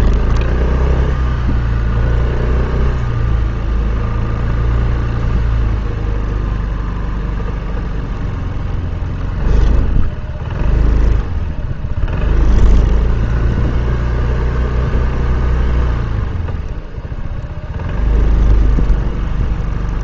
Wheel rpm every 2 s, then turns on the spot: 0, 0, 0, 0, 0, 0, 0, 0, 0, 0.
none